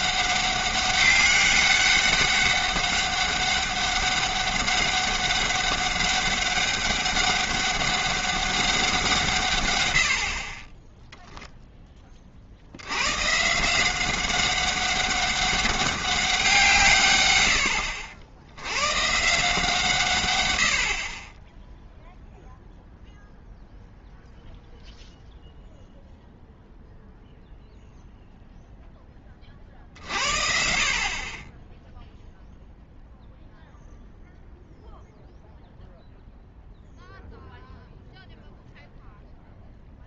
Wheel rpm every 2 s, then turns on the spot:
200, 200, 200, 200, 190, 20, 80, 190, 170, 100, 80, 0, 0, 0, 0, 50, 0, 0, 0, 0.
none